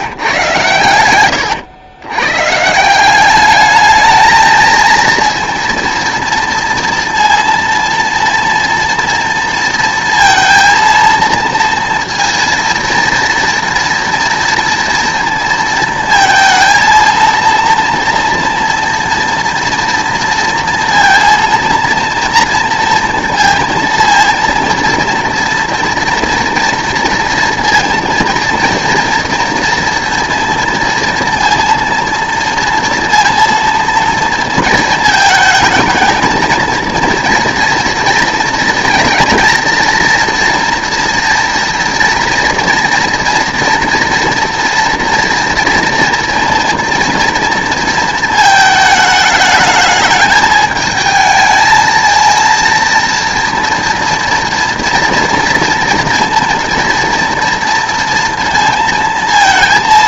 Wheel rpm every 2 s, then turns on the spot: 110, 170, 230, 230, 230, 230, 230, 230, 230, 230, 230, 230, 230, 230, 230, 230, 230, 230, 220, 230, 230, 230, 230, 240, 220, 220, 230, 230, 230, 230.
none